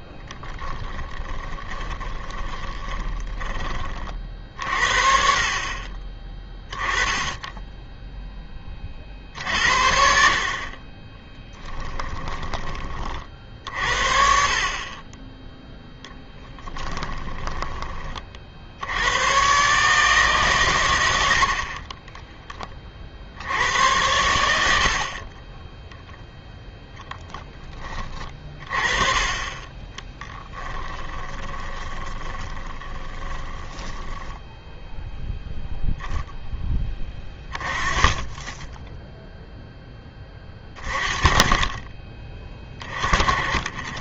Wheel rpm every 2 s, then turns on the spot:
10, 20, 50, 10, 30, 40, 20, 40, 10, 60, 120, 20, 70, 0, 30, 10, 10, 0, 10, 10, 30, 30.
0-4 16-18 30-34